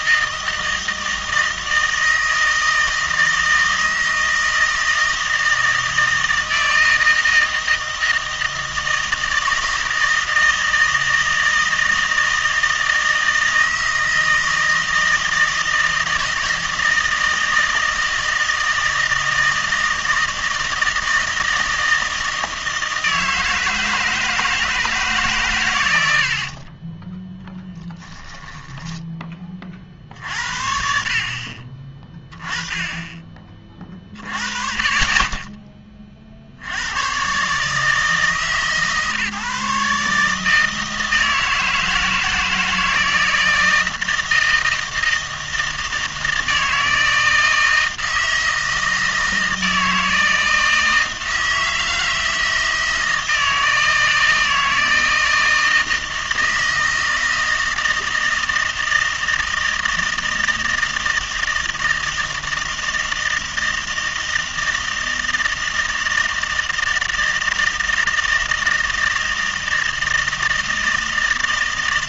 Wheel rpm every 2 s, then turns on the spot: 160, 160, 160, 160, 160, 160, 160, 160, 160, 160, 160, 160, 160, 30, 0, 60, 20, 30, 80, 140, 160, 160, 160, 160, 160, 160, 160, 160, 160, 160, 160, 160, 160, 160, 160, 160.
none